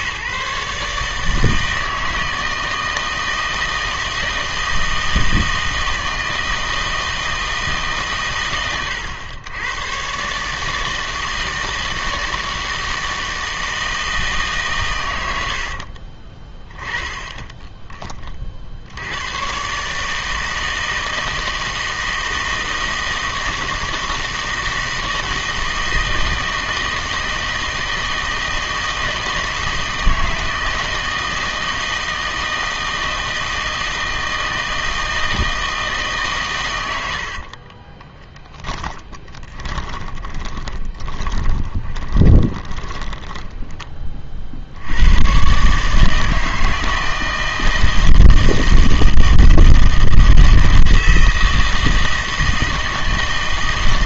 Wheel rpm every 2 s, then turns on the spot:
140, 160, 160, 160, 110, 150, 160, 130, 20, 60, 160, 160, 160, 160, 160, 160, 160, 160, 120, 20, 20, 20, 60, 160, 160, 160, 160.
38-44